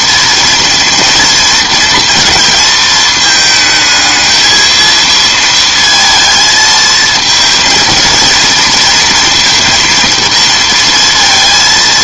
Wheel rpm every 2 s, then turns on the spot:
230, 220, 220, 220, 230, 230.
none